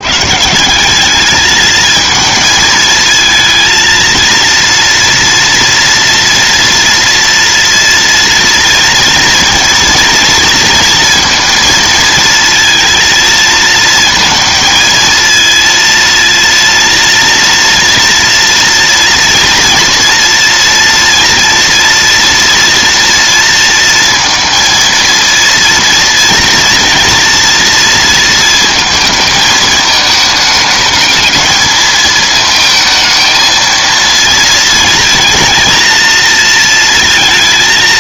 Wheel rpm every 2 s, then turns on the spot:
190, 220, 230, 230, 230, 230, 230, 230, 230, 230, 230, 230, 230, 230, 220, 220, 220, 230, 230.
none